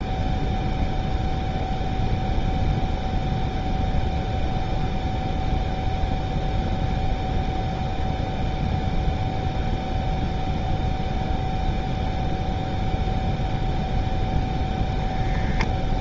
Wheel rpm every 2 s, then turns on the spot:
0, 0, 0, 0, 0, 0, 0, 0.
none